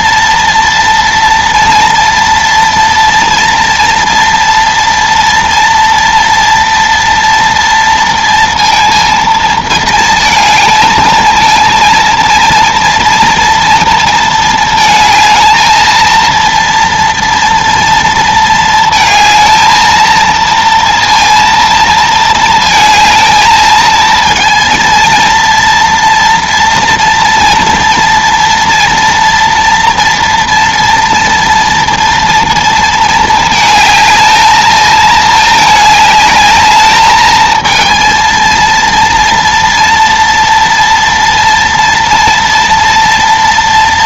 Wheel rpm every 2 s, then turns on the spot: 230, 230, 230, 230, 230, 220, 230, 230, 230, 230, 230, 220, 230, 230, 230, 230, 230, 220, 210, 230, 230, 230.
none